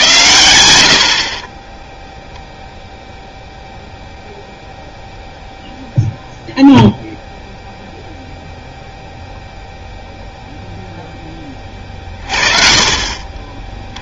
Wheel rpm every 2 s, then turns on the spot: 70, 0, 0, 0, 0, 0, 30.
none